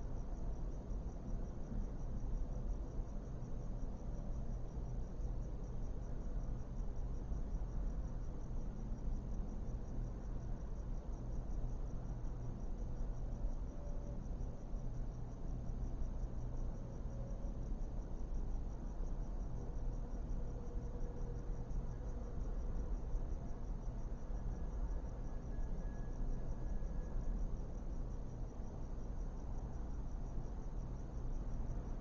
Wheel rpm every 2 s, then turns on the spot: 0, 0, 0, 0, 0, 0, 0, 0, 0, 0, 0, 0, 0, 0, 0, 0.
none